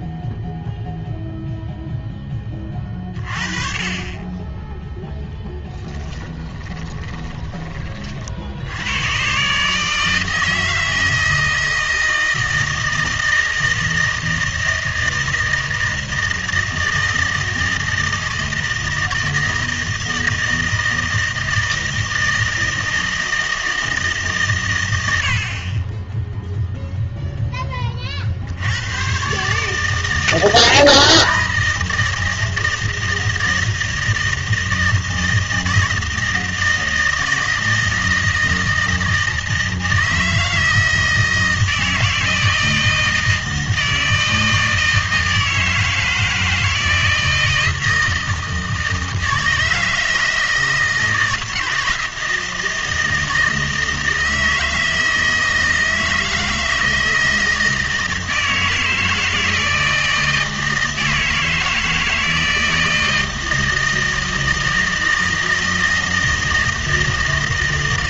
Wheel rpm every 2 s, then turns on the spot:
0, 20, 10, 20, 80, 160, 160, 160, 160, 160, 160, 160, 120, 0, 90, 160, 160, 160, 160, 160, 160, 160, 160, 160, 160, 160, 160, 160, 160, 160, 160, 160, 160, 160.
6-8